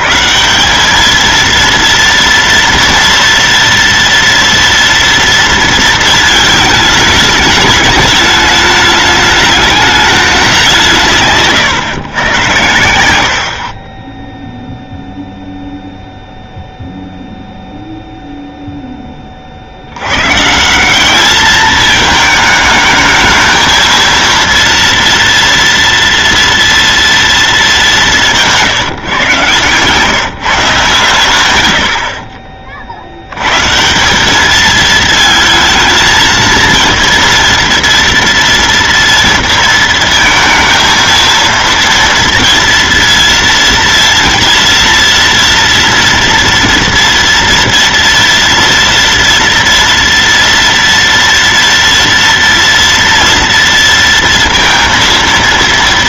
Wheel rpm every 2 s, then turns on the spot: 180, 230, 230, 220, 210, 180, 100, 0, 0, 0, 160, 220, 230, 230, 160, 140, 40, 210, 220, 230, 230, 230, 230, 230, 230, 230, 230, 230.
none